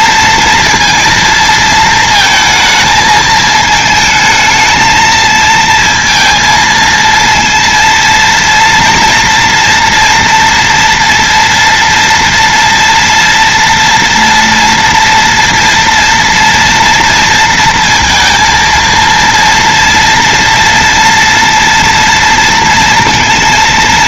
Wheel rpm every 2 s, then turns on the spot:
230, 220, 220, 220, 230, 230, 230, 230, 230, 230, 230, 230.
none